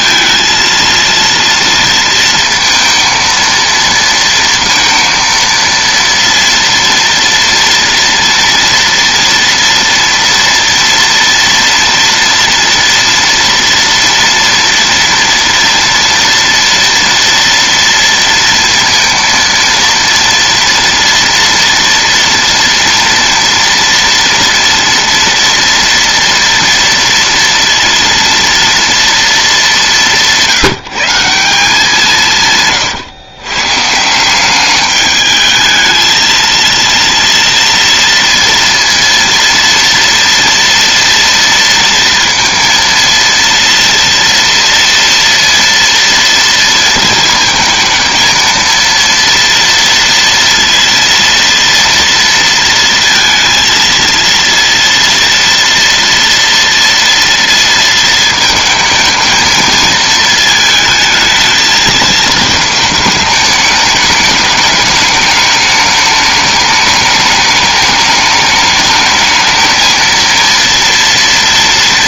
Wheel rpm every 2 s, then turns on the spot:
230, 230, 230, 230, 230, 230, 230, 230, 230, 230, 230, 230, 240, 230, 230, 180, 140, 200, 230, 230, 230, 230, 230, 230, 220, 230, 230, 230, 230, 220, 220, 220, 210, 210, 210, 230.
32-34